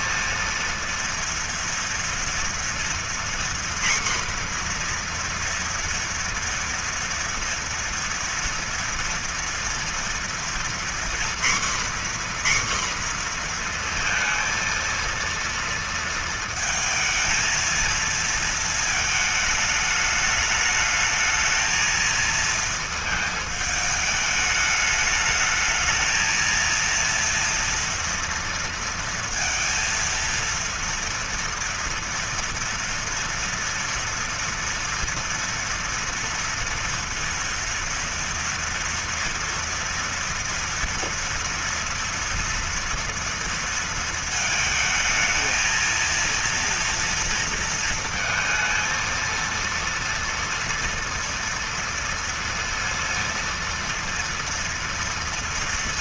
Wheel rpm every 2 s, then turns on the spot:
230, 240, 240, 230, 230, 240, 250, 230, 230, 220, 210, 220, 210, 230, 230, 230, 230, 230, 230, 230, 230, 230, 220, 230, 220, 230, 230, 230.
none